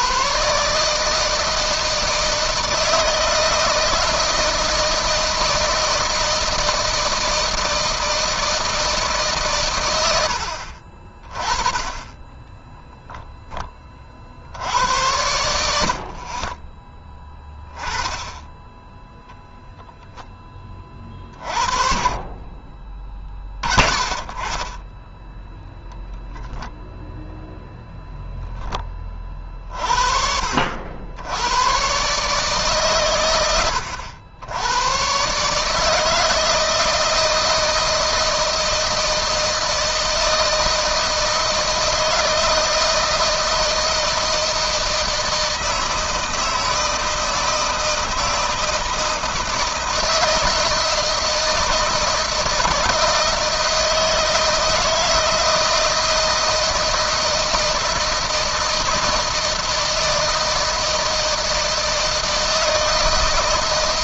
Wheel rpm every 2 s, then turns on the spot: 150, 160, 160, 160, 150, 40, 0, 80, 20, 10, 30, 30, 10, 0, 20, 80, 120, 120, 160, 160, 160, 160, 160, 160, 160, 160, 160, 160, 160, 160, 160, 160.
none